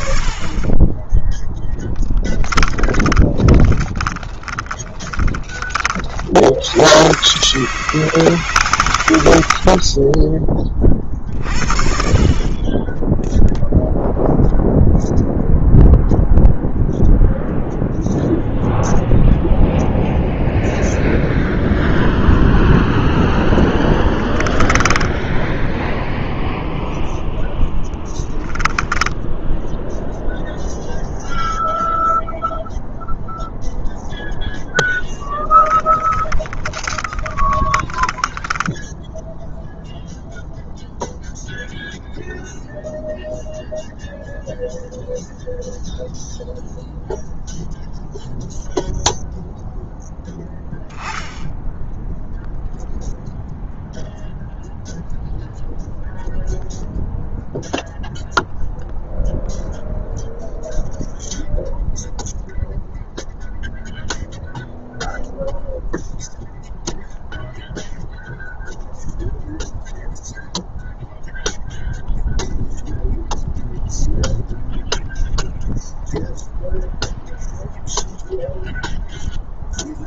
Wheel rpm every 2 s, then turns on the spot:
20, 20, 30, 110, 120, 30, 10, 0, 0, 0, 0, 0, 10, 0, 10, 0, 0, 10, 20, 10, 0, 0, 0, 0, 0, 0, 0, 0, 0, 0, 0, 0, 0, 0, 0, 0, 0, 0, 0, 0.
2-6 12-14 24-26 28-30 34-40